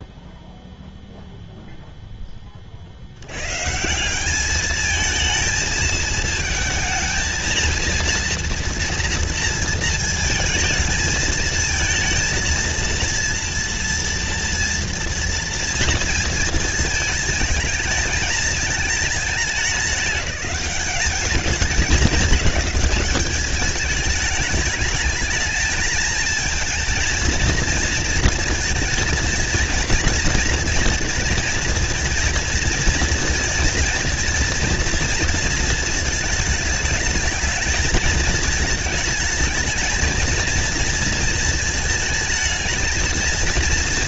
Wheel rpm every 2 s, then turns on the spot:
0, 60, 220, 220, 230, 220, 230, 230, 230, 220, 200, 200, 210, 220, 230, 240, 230, 230, 220, 220, 230, 220.
none